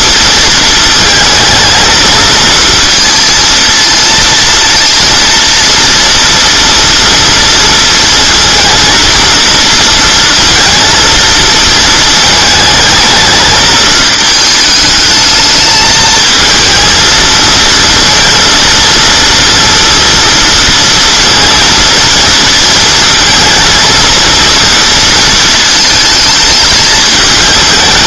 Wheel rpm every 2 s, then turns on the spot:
220, 230, 230, 230, 230, 230, 220, 220, 220, 230, 230, 230, 230, 210.
none